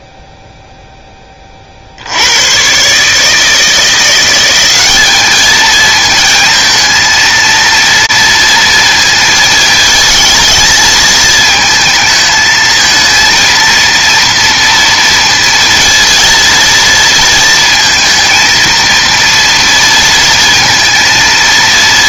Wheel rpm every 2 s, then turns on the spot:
0, 70, 170, 220, 230, 220, 220, 230, 230, 230, 230.
none